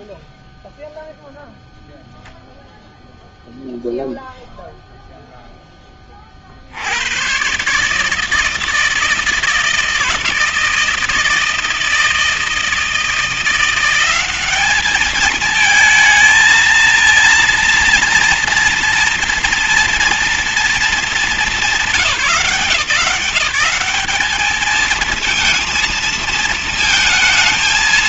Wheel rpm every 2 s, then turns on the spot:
10, 0, 0, 20, 130, 160, 160, 170, 220, 230, 230, 180, 190, 230.
none